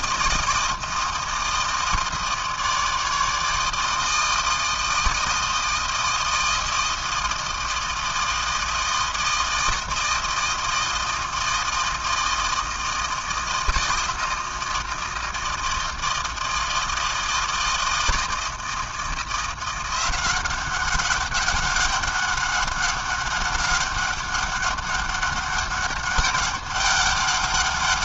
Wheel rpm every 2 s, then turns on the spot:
160, 160, 160, 160, 160, 160, 160, 160, 160, 160, 190, 200, 200, 200.
none